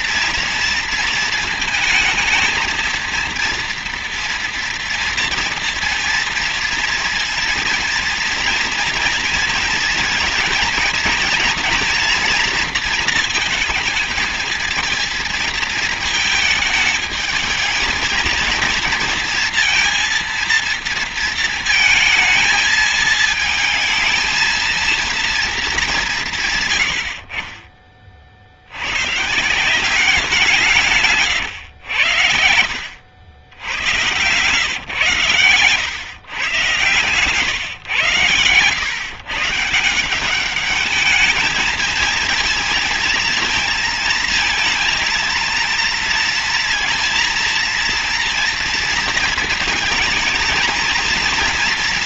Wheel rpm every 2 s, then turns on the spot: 230, 230, 240, 230, 230, 230, 230, 220, 220, 230, 230, 220, 230, 80, 120, 150, 80, 140, 130, 130, 210, 230, 230, 230, 230, 230.
none